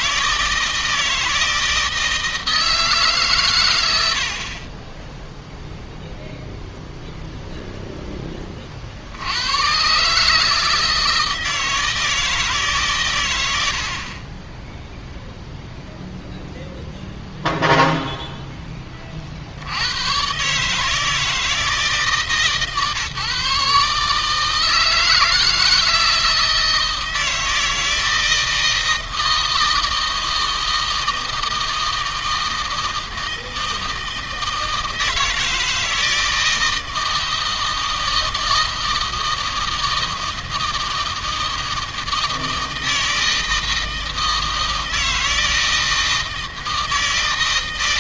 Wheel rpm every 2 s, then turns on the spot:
160, 150, 10, 0, 70, 160, 120, 0, 0, 30, 150, 150, 160, 160, 160, 160, 160, 160, 160, 160, 160, 160, 160, 160.
none